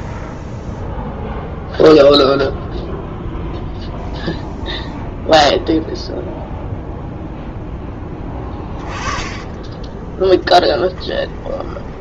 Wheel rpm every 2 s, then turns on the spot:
0, 0, 0, 0, 20, 30.
8-12